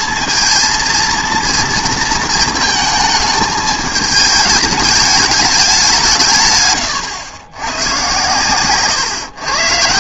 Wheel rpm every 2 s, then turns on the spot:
230, 220, 210, 120, 130.
none